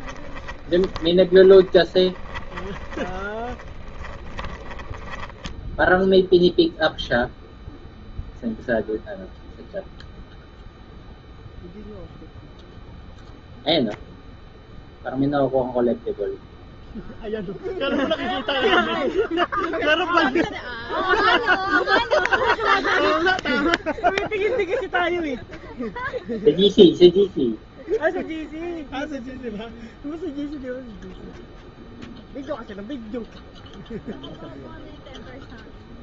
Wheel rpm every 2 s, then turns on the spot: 30, 30, 10, 0, 0, 0, 0, 0, 0, 0, 0, 0, 0, 0, 0, 0, 0, 0.
0-6